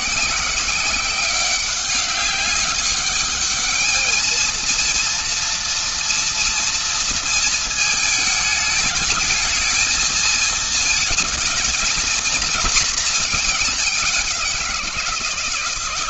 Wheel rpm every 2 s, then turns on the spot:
190, 200, 230, 230, 210, 230, 230, 170.
none